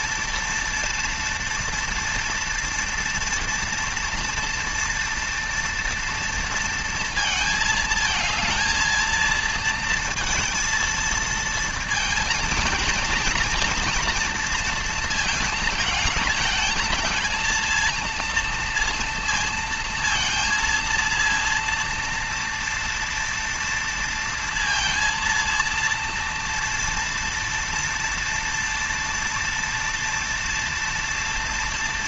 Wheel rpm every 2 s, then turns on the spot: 230, 230, 230, 230, 230, 230, 230, 230, 220, 230, 230, 230, 230, 230, 230, 230.
none